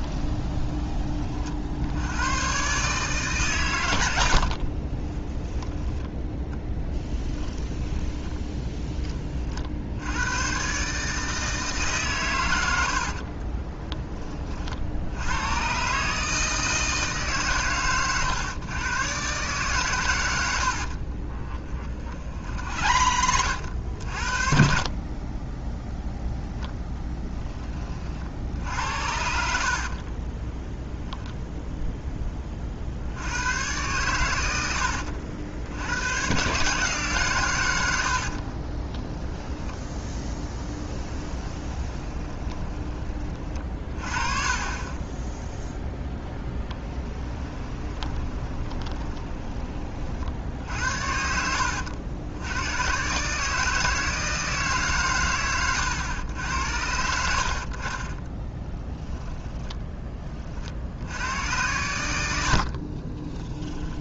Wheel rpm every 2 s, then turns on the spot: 30, 140, 30, 10, 20, 130, 80, 70, 160, 120, 60, 70, 40, 10, 70, 0, 50, 80, 140, 20, 10, 20, 20, 10, 20, 70, 110, 150, 70, 10, 60, 50.
4-8 20-22 28-30 38-42 48-50 58-60 62-64